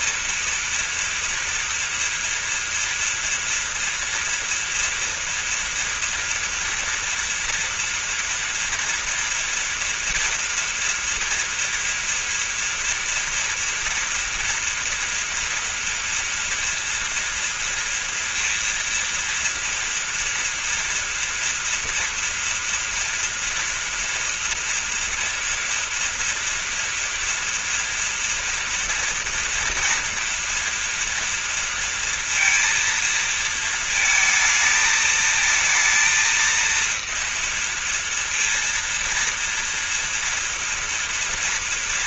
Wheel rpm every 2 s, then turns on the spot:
230, 230, 230, 230, 230, 240, 230, 230, 230, 240, 240, 230, 240, 230, 230, 240, 230, 220, 230, 230, 230.
none